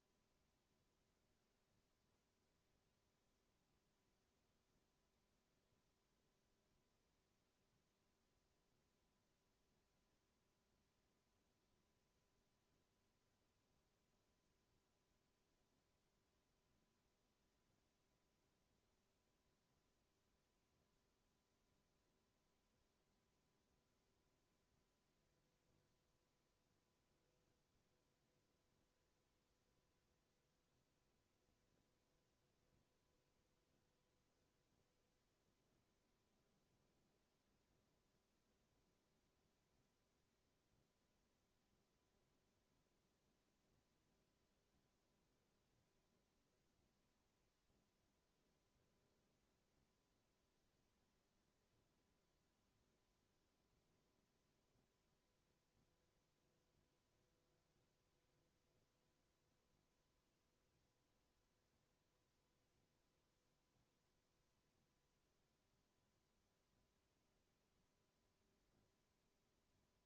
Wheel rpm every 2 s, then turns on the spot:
0, 0, 0, 0, 0, 0, 0, 0, 0, 0, 0, 0, 0, 0, 0, 0, 0, 0, 0, 0, 0, 0, 0, 0, 0, 0, 0, 0, 0, 0, 0, 0, 0, 0, 0.
none